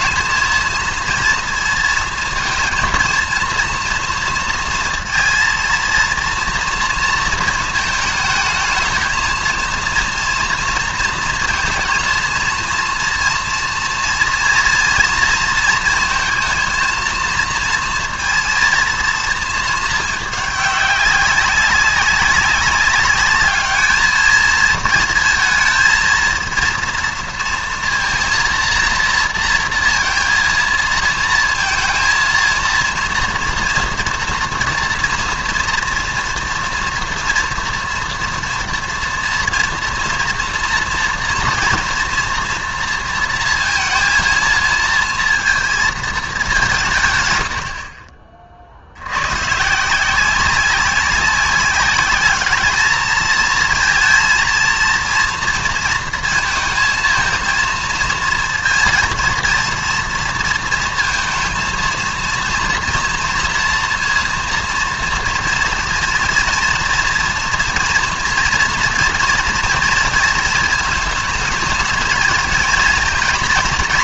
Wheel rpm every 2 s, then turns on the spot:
230, 230, 230, 230, 220, 230, 230, 230, 230, 230, 200, 200, 220, 230, 230, 230, 230, 230, 240, 230, 230, 240, 230, 180, 50, 190, 210, 230, 230, 230, 230, 230, 230, 230, 240, 230, 230.
none